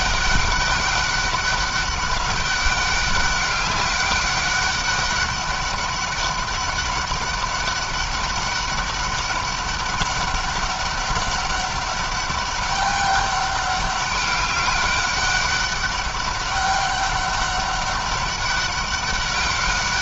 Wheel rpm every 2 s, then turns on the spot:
200, 200, 200, 200, 200, 200, 200, 200, 200, 200.
none